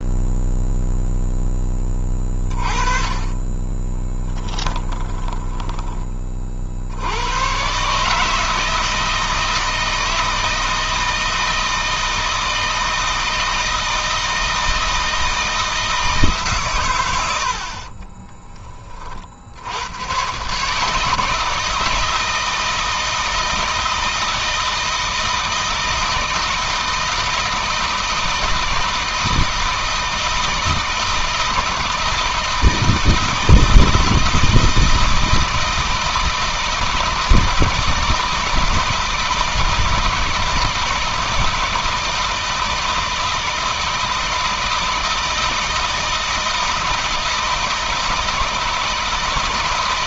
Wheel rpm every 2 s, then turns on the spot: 0, 30, 20, 60, 160, 160, 160, 160, 140, 30, 140, 160, 170, 160, 160, 160, 160, 160, 160, 160, 160, 160, 160, 160, 160.
4-6